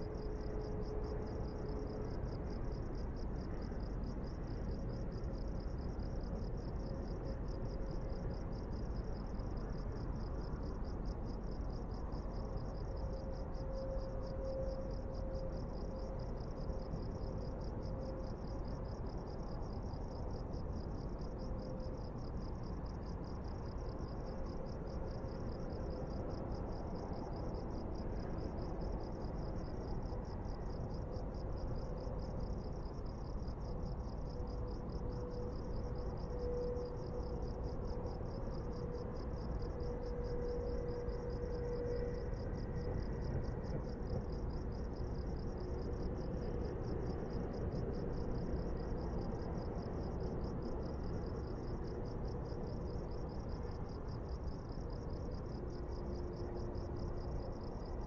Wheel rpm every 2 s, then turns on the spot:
0, 0, 0, 0, 0, 0, 0, 0, 0, 0, 0, 0, 0, 0, 0, 0, 0, 0, 0, 0, 0, 0, 0, 0, 0, 0, 0, 0, 0.
none